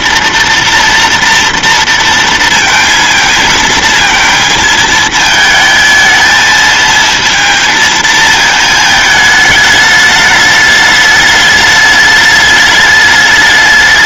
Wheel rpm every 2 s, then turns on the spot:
230, 230, 220, 220, 220, 210, 210.
none